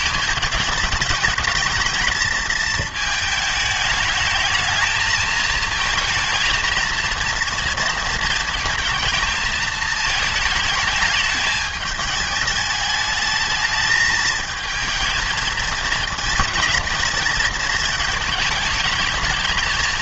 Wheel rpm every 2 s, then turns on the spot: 210, 220, 220, 230, 230, 220, 210, 220, 220, 220.
none